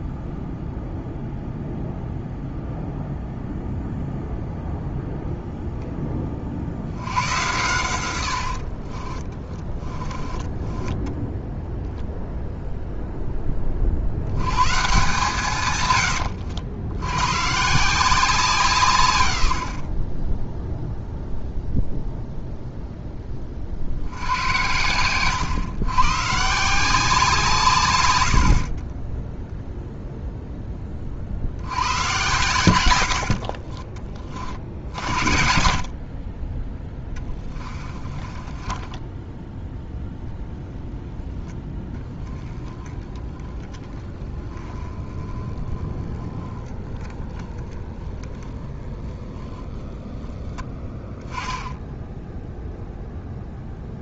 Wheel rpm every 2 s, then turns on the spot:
0, 0, 0, 80, 50, 10, 0, 130, 90, 150, 0, 0, 100, 160, 50, 20, 100, 60, 20, 10, 0, 20, 20, 10, 10, 10, 0.
8-12 28-30 38-40